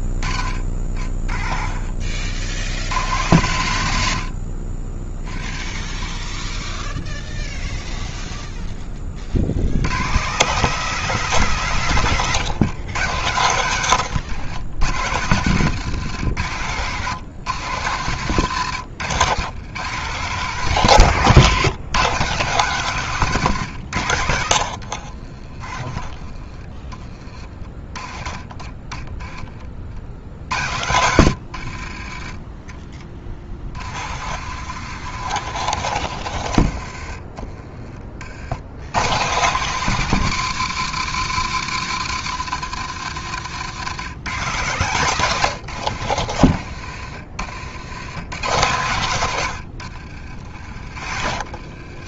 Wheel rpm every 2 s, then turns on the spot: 30, 60, 60, 10, 10, 170, 120, 110, 120, 130, 150, 150, 60, 20, 20, 100, 30, 100, 40, 150, 170, 110, 140, 70, 120, 50.
30-36 42-46 48-50